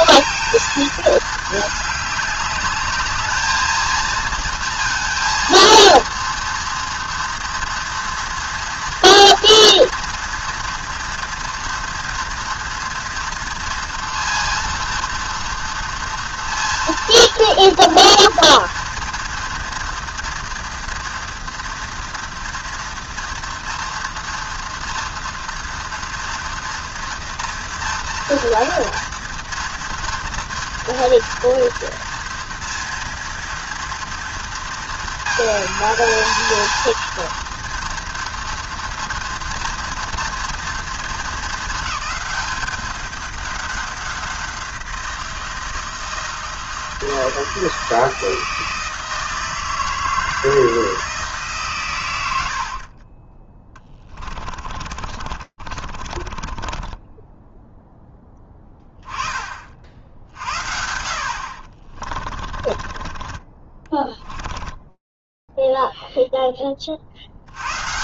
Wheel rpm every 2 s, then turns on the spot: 220, 210, 230, 230, 230, 230, 230, 230, 230, 230, 240, 230, 230, 230, 230, 230, 230, 230, 230, 230, 230, 200, 180, 160, 160, 160, 60, 40, 20, 10, 60, 30, 10, 70.
52-58 62-66